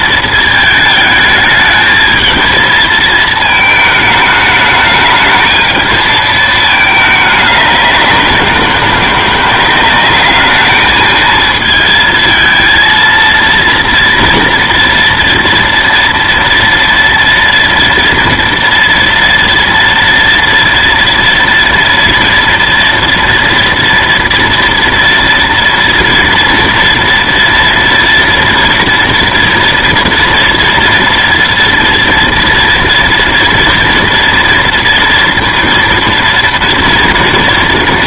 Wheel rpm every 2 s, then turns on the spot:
220, 220, 210, 220, 180, 210, 220, 230, 230, 230, 230, 230, 230, 230, 230, 230, 230, 230, 230.
none